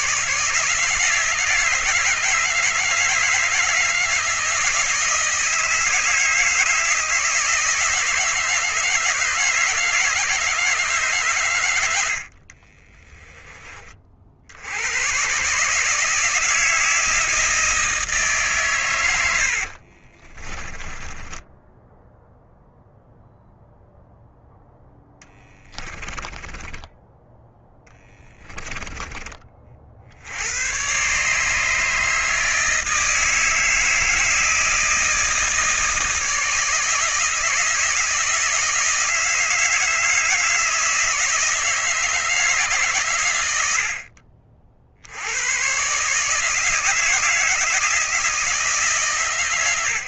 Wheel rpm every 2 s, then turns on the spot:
160, 160, 160, 160, 160, 150, 30, 90, 160, 130, 20, 0, 0, 10, 10, 110, 160, 160, 160, 160, 160, 140, 60, 160, 150.
12-14 20-22 26-30